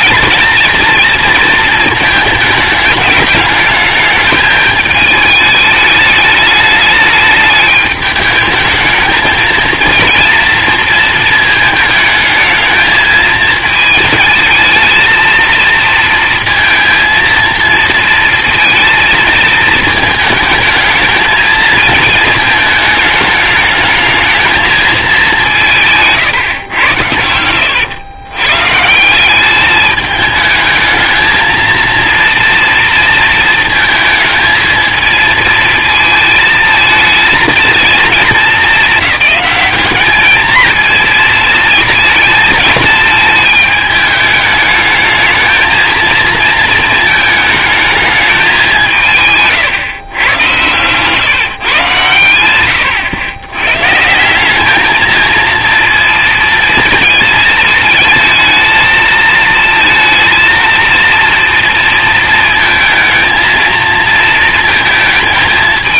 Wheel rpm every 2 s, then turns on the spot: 220, 210, 210, 210, 220, 230, 220, 220, 230, 230, 220, 220, 220, 130, 130, 220, 230, 220, 220, 220, 230, 230, 210, 230, 190, 110, 110, 210, 230, 220, 230, 230, 230.
50-52